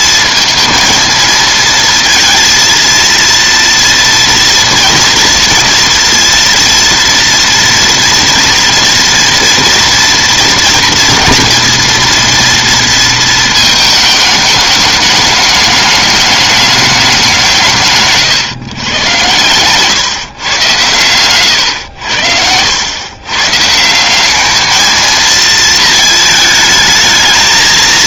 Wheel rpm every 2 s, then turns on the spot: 230, 230, 240, 240, 240, 230, 230, 210, 210, 130, 120, 90, 220, 220.
none